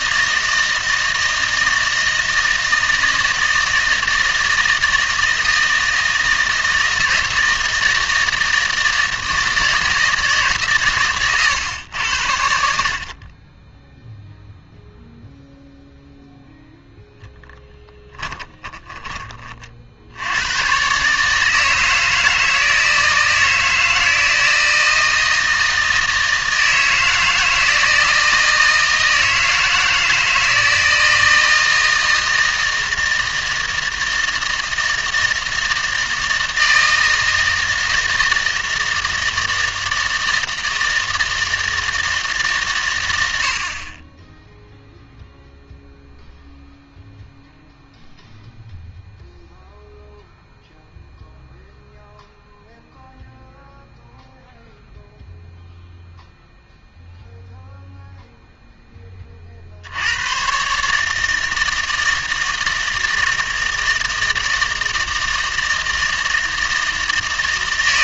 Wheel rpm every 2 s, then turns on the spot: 160, 160, 160, 160, 160, 140, 60, 0, 0, 20, 120, 160, 160, 160, 160, 160, 160, 160, 160, 160, 160, 130, 0, 0, 0, 0, 0, 0, 0, 10, 140, 160, 160, 160.
18-20